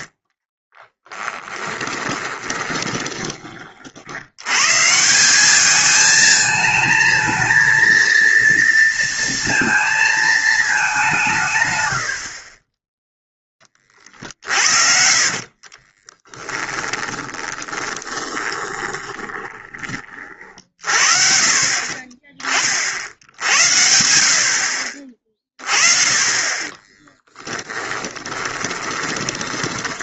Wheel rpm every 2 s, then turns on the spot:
30, 20, 130, 220, 230, 210, 30, 50, 10, 20, 40, 40, 50, 20, 20.
0-4 14-20 26-30